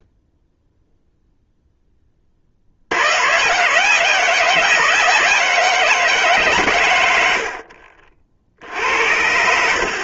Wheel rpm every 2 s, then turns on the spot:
0, 60, 170, 140, 60.
none